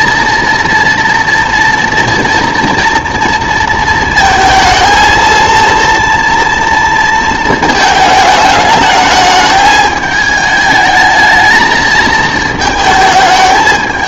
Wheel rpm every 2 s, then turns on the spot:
230, 230, 220, 230, 210, 220, 220.
none